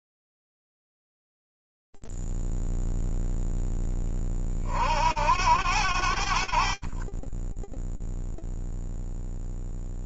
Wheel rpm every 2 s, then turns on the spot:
0, 0, 50, 40, 0.
none